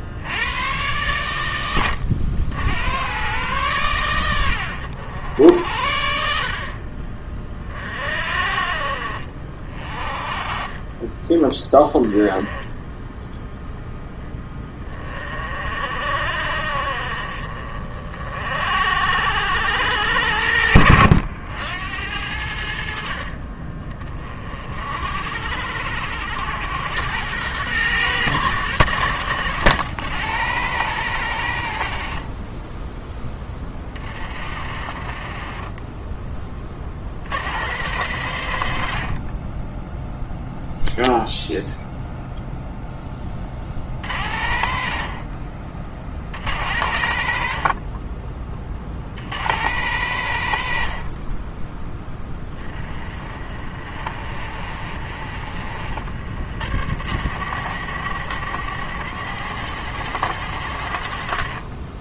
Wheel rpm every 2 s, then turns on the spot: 110, 100, 70, 40, 50, 20, 10, 20, 40, 60, 70, 60, 60, 100, 100, 120, 10, 40, 50, 70, 0, 10, 60, 70, 60, 60, 30, 50, 70, 80, 60.
10-12 34-36 52-56